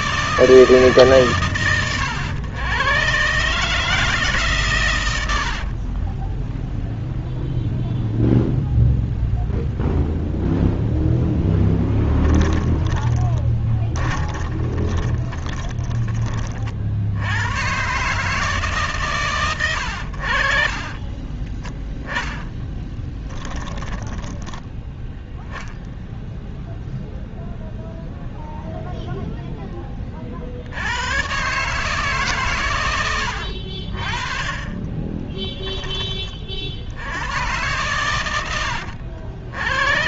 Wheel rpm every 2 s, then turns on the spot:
130, 140, 80, 0, 0, 0, 10, 20, 80, 130, 30, 20, 10, 0, 0, 100, 110, 20, 60, 100.
12-16 20-24 34-36